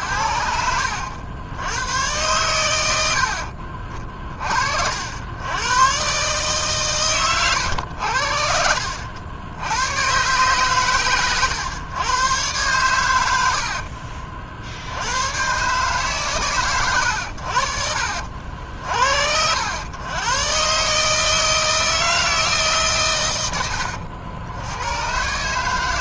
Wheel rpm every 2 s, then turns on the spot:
80, 110, 50, 140, 60, 130, 120, 60, 100, 70, 130, 150, 90.
none